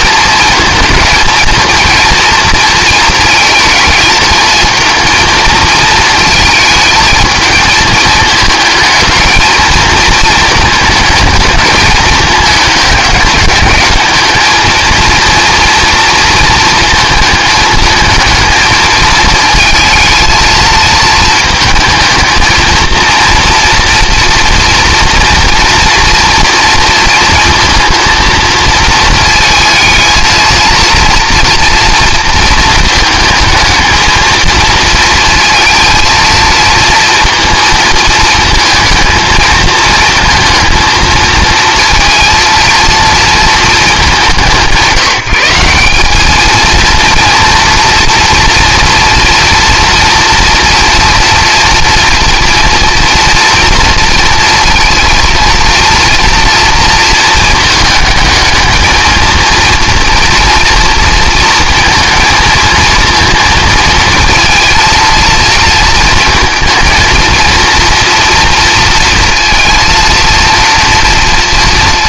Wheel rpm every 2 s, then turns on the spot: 220, 230, 220, 220, 220, 220, 210, 220, 230, 220, 220, 230, 230, 230, 230, 230, 220, 220, 230, 220, 230, 230, 170, 220, 230, 240, 230, 230, 230, 220, 230, 230, 230, 230, 230, 230.
none